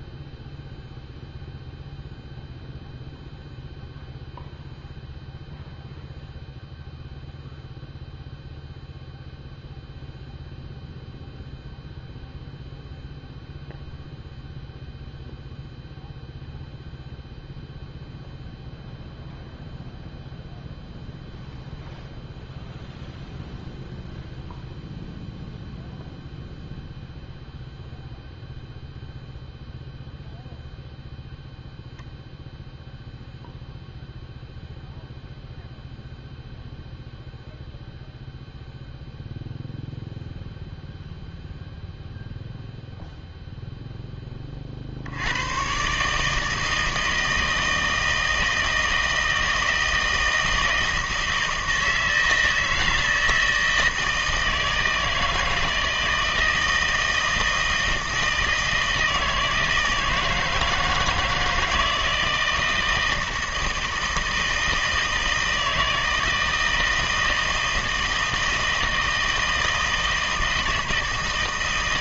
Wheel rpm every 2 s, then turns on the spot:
0, 0, 0, 0, 0, 0, 0, 0, 0, 0, 0, 0, 0, 0, 0, 0, 0, 0, 0, 0, 0, 0, 30, 160, 160, 160, 160, 160, 160, 160, 160, 160, 160, 160, 160, 160.
none